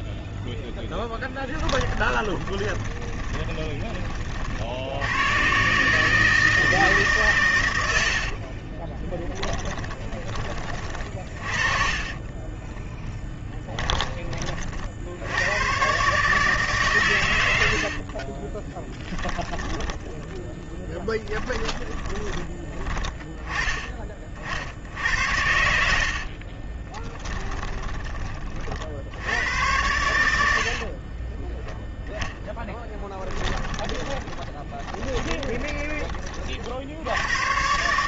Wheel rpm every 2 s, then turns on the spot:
10, 20, 70, 150, 20, 30, 10, 40, 150, 30, 10, 20, 60, 30, 40, 60, 10, 20, 40.
0-4 8-12 18-22 26-28 30-36